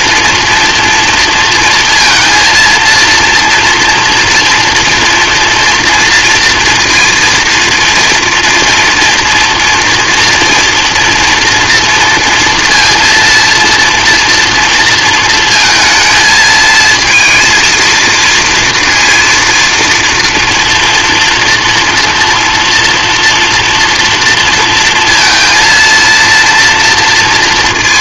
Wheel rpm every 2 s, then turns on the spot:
230, 230, 230, 230, 240, 230, 230, 230, 230, 230, 230, 230, 230, 230.
none